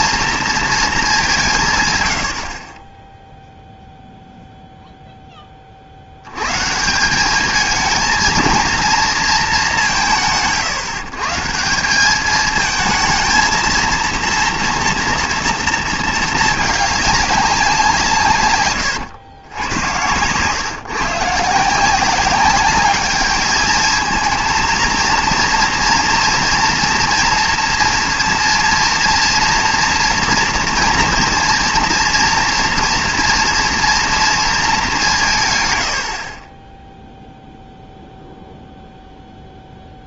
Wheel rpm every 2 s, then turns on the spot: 220, 40, 0, 140, 230, 150, 220, 230, 210, 120, 130, 200, 230, 230, 230, 230, 230, 220, 20, 0.
18-20